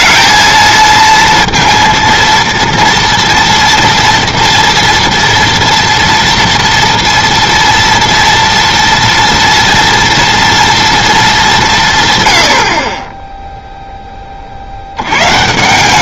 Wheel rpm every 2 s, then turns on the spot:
230, 230, 230, 230, 230, 230, 60, 60.
none